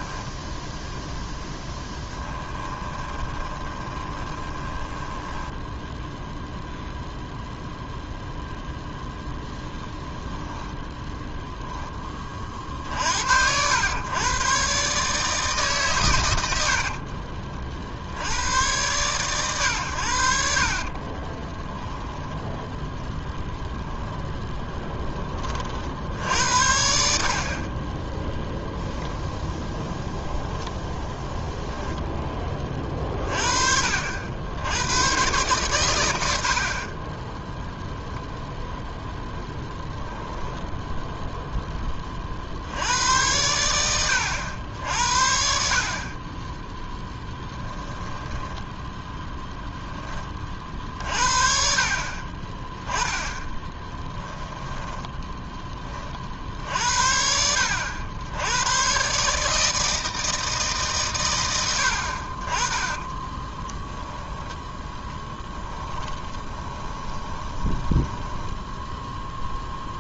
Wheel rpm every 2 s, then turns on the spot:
0, 10, 20, 0, 0, 10, 50, 130, 90, 100, 60, 10, 10, 60, 0, 0, 30, 100, 50, 0, 0, 80, 70, 10, 10, 50, 20, 10, 60, 110, 140, 30, 10, 20, 10.
2-6 16-18 20-22 46-50 54-56 62-70